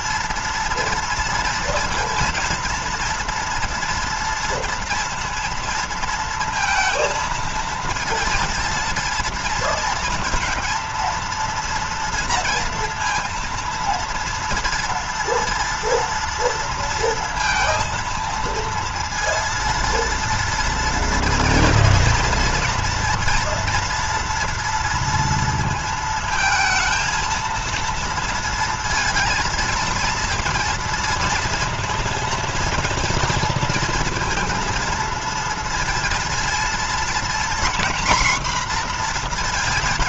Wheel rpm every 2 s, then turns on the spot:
230, 230, 230, 230, 230, 230, 230, 230, 230, 230, 240, 230, 230, 230, 230, 230, 230, 230, 230, 240.
none